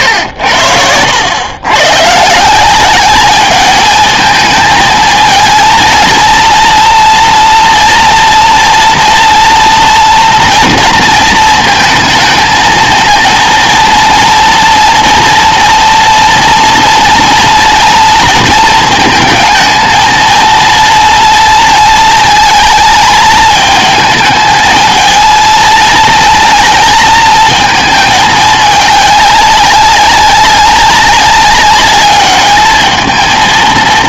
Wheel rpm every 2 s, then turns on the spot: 80, 190, 220, 230, 230, 230, 230, 230, 230, 230, 230, 220, 220, 230, 210, 200, 220.
none